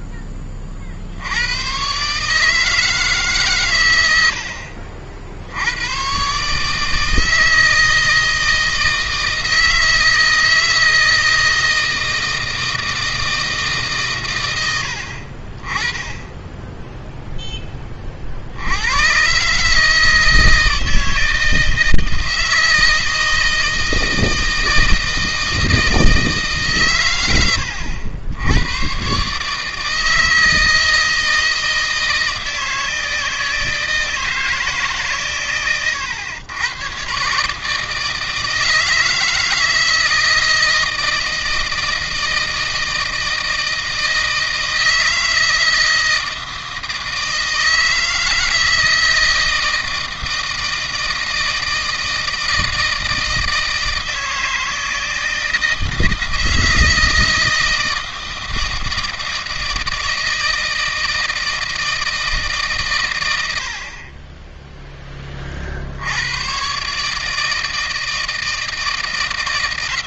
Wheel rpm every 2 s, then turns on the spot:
60, 150, 70, 160, 160, 160, 160, 70, 10, 100, 160, 160, 160, 120, 120, 160, 160, 140, 130, 160, 160, 160, 160, 160, 160, 160, 160, 160, 160, 160, 160, 120, 10, 140, 160.
none